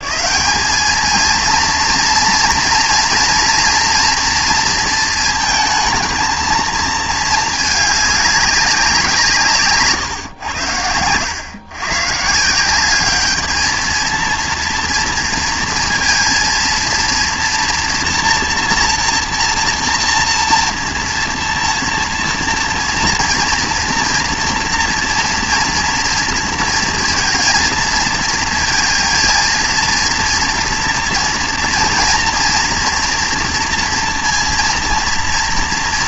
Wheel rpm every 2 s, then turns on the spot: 200, 230, 230, 230, 200, 100, 170, 230, 230, 230, 230, 230, 230, 230, 230, 240, 230, 230.
none